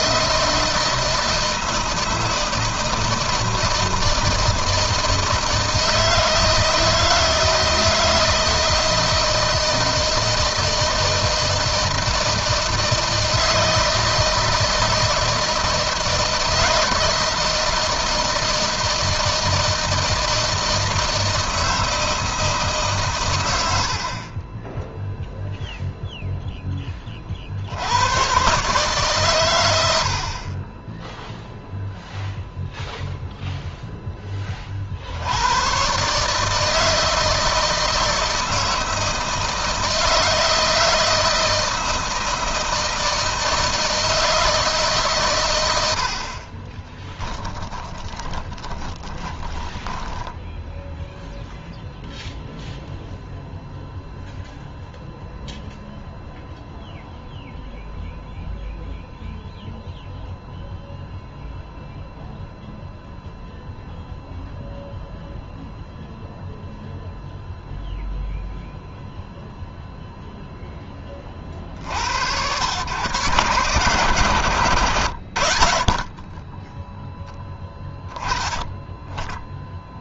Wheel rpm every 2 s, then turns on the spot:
160, 160, 160, 160, 160, 160, 160, 160, 160, 160, 160, 120, 0, 30, 130, 10, 0, 70, 160, 160, 160, 160, 140, 20, 20, 0, 0, 0, 0, 0, 0, 0, 0, 0, 0, 30, 120, 110, 10, 10.
46-50